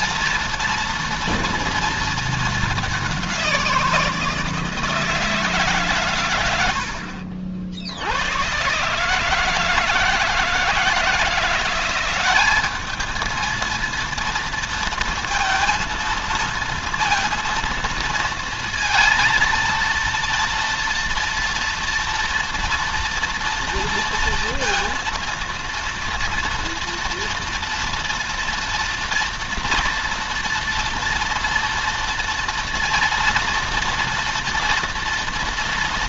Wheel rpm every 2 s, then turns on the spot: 230, 200, 160, 80, 140, 160, 210, 230, 230, 230, 240, 230, 230, 230, 230, 240, 230, 230.
none